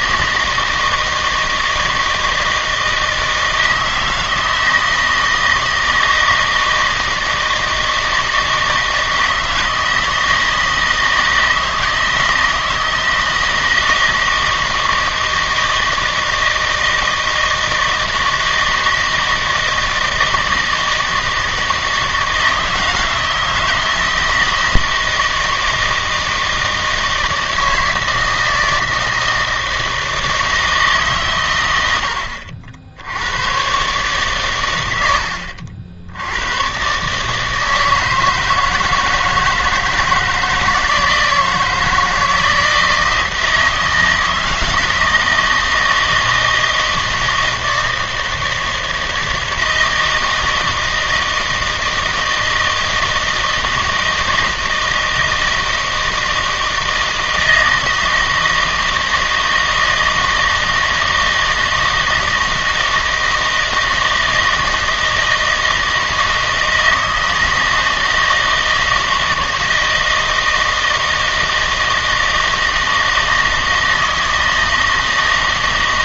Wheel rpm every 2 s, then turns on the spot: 160, 160, 160, 160, 160, 160, 160, 160, 160, 160, 160, 160, 160, 160, 160, 160, 70, 100, 120, 160, 160, 160, 160, 160, 160, 160, 160, 160, 160, 160, 160, 160, 160, 160, 160, 160, 160, 160.
none